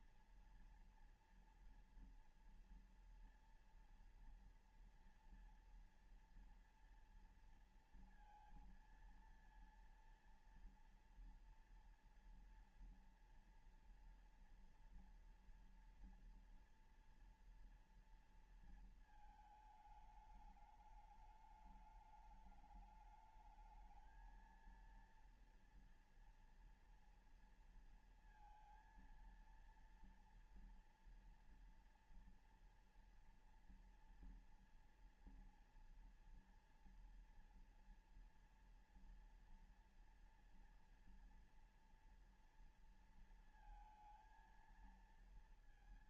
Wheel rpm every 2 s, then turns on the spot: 240, 230, 230, 230, 230, 230, 230, 230, 230, 230, 210, 210, 220, 230, 230, 230, 230, 230, 230, 230, 240, 230, 230.
none